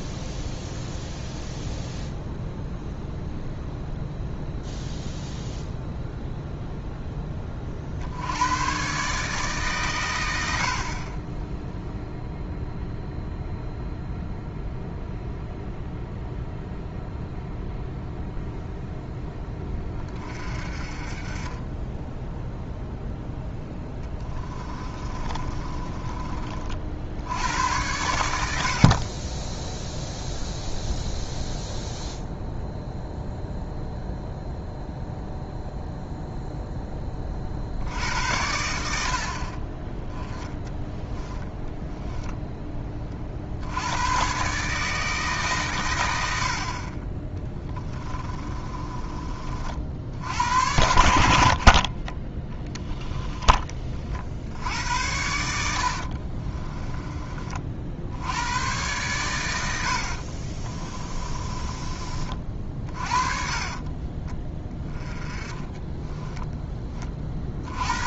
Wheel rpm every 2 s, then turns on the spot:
0, 0, 0, 0, 110, 60, 0, 0, 0, 0, 30, 0, 20, 50, 60, 0, 0, 0, 0, 70, 10, 20, 150, 50, 20, 90, 10, 80, 30, 100, 40, 40, 20, 10.
24-26 40-42 48-50 56-58 60-64